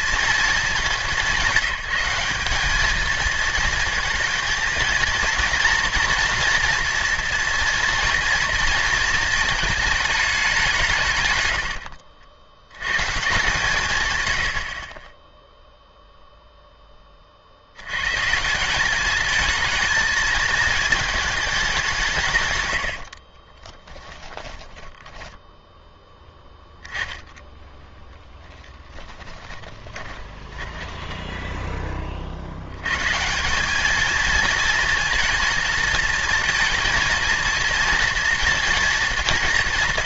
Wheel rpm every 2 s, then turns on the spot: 200, 220, 220, 230, 230, 170, 110, 60, 10, 180, 220, 110, 20, 10, 10, 20, 110, 230, 230, 230.
24-26 28-32